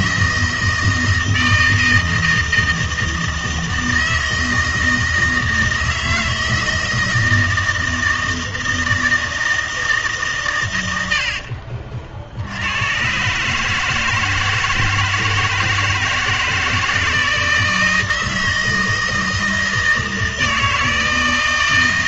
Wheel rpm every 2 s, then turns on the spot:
160, 160, 160, 160, 160, 120, 90, 160, 160, 160, 160.
none